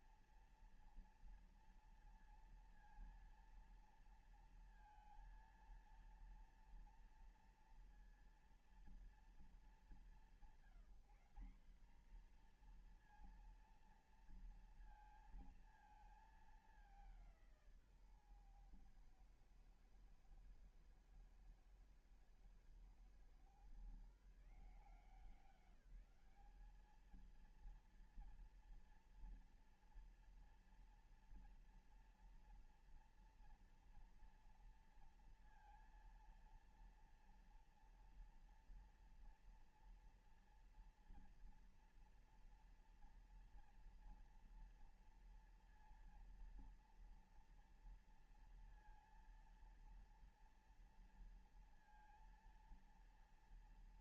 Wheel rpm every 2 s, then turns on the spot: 230, 230, 230, 230, 230, 180, 220, 230, 210, 130, 120, 110, 150, 200, 230, 230, 230, 230, 230, 230, 230, 230, 230, 230, 230, 230, 230.
none